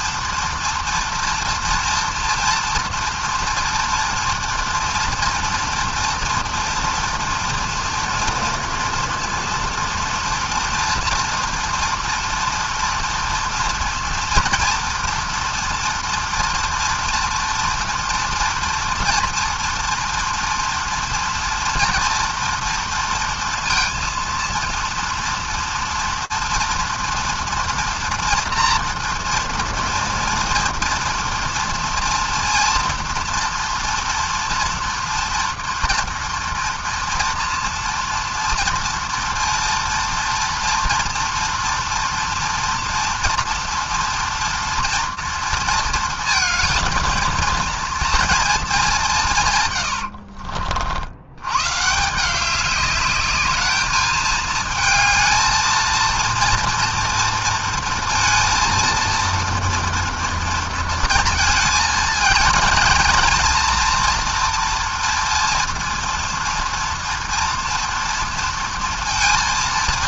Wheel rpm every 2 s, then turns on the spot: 230, 230, 230, 230, 230, 230, 230, 230, 230, 230, 230, 230, 230, 230, 240, 230, 230, 240, 230, 230, 240, 230, 240, 230, 220, 50, 200, 220, 230, 230, 230, 220, 240, 230, 230.
none